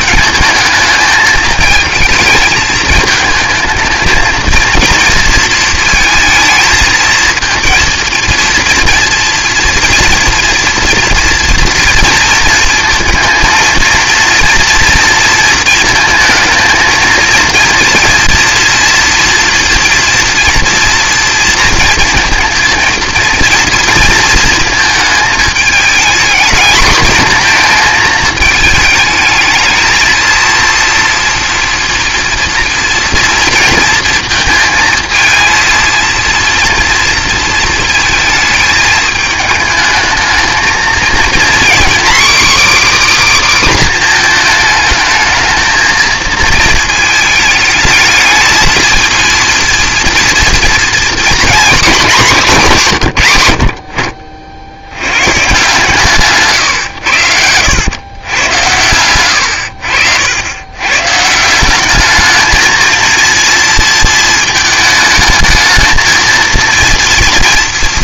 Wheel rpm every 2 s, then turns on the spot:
220, 220, 230, 220, 230, 230, 230, 230, 230, 230, 240, 230, 230, 230, 220, 230, 230, 220, 230, 220, 220, 290, 220, 220, 220, 230, 190, 70, 130, 110, 100, 220, 220, 230.
56-58